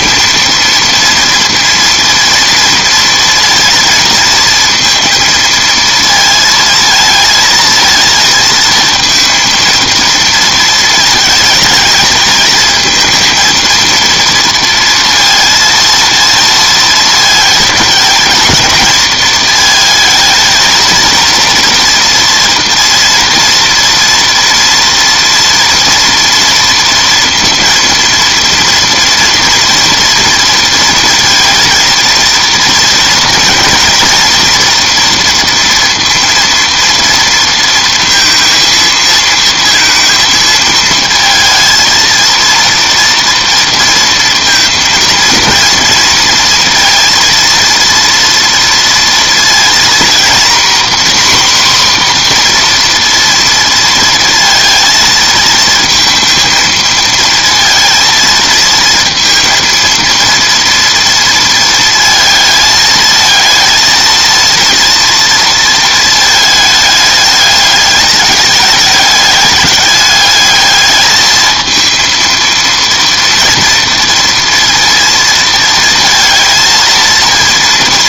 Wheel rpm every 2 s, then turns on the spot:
230, 230, 230, 230, 230, 220, 220, 230, 220, 220, 230, 240, 240, 230, 230, 230, 230, 240, 230, 230, 220, 230, 230, 230, 230, 240, 250, 230, 230, 230, 230, 220, 230, 220, 210, 210, 230, 230, 230.
none